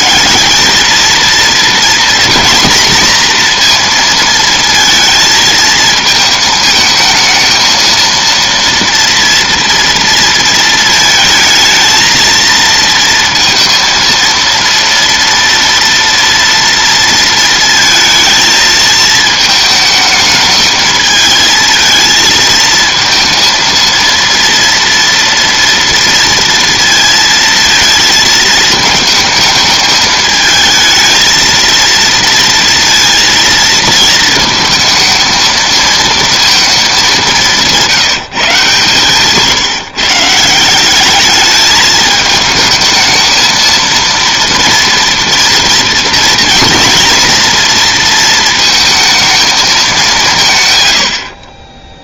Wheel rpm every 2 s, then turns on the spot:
220, 230, 220, 220, 230, 230, 230, 230, 230, 220, 220, 220, 230, 230, 220, 220, 230, 220, 200, 140, 200, 220, 230, 230, 220, 80.
none